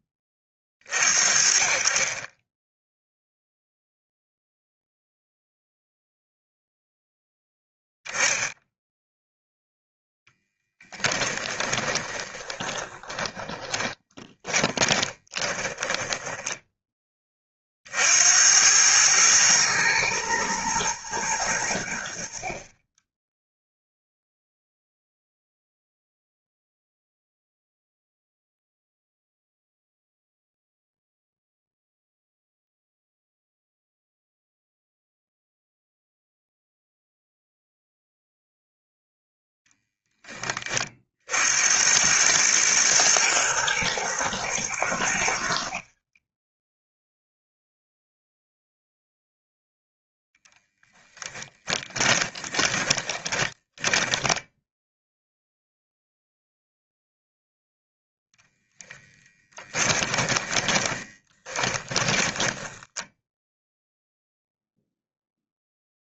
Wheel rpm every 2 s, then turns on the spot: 40, 0, 0, 0, 0, 10, 20, 10, 10, 100, 110, 20, 0, 0, 0, 0, 0, 0, 0, 0, 30, 110, 100, 10, 0, 10, 20, 0, 0, 10, 20, 10, 0.
12-16 50-54 60-64